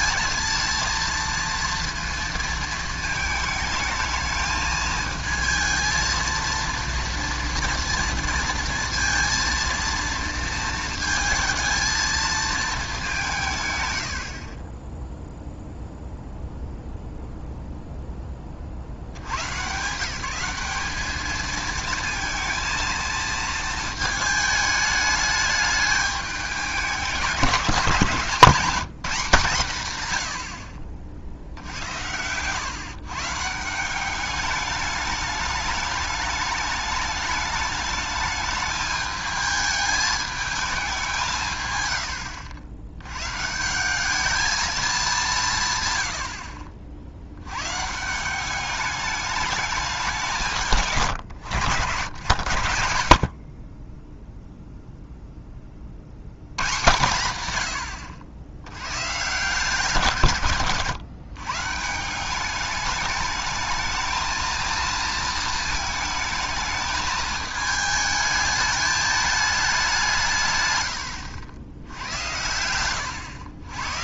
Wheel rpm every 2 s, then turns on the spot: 230, 230, 220, 230, 230, 230, 220, 20, 0, 50, 200, 220, 210, 200, 190, 60, 120, 210, 210, 210, 200, 90, 210, 50, 200, 140, 70, 0, 110, 110, 130, 200, 230, 220, 210, 120, 100.
60-62